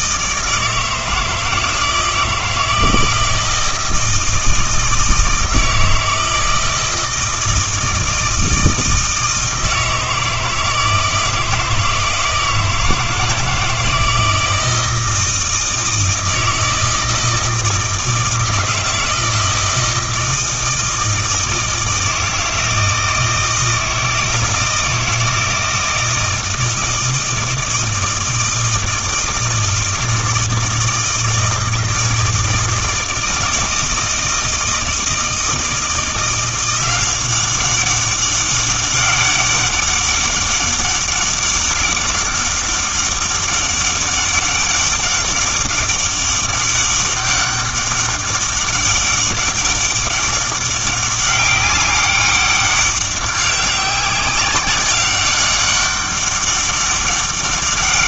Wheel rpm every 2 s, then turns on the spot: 160, 160, 160, 160, 160, 160, 160, 170, 160, 160, 160, 160, 160, 160, 160, 160, 160, 160, 180, 200, 200, 200, 200, 200, 200, 200, 200, 200, 200.
none